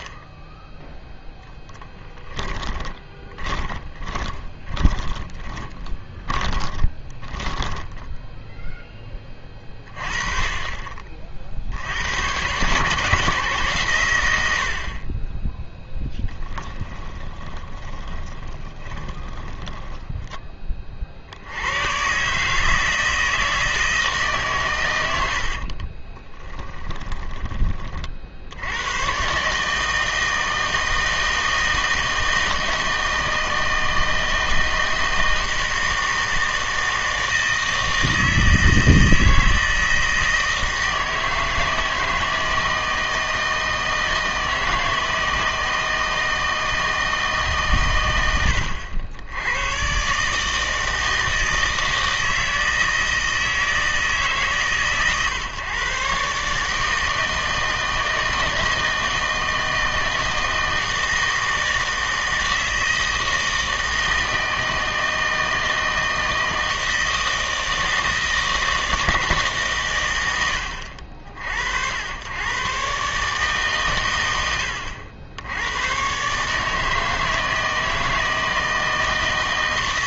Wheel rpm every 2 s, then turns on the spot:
10, 10, 20, 20, 10, 30, 130, 80, 20, 20, 30, 150, 130, 20, 90, 160, 160, 160, 160, 160, 160, 160, 160, 160, 90, 160, 160, 140, 150, 160, 160, 160, 160, 160, 160, 90, 120, 90, 160, 160.
2-8 16-20 26-28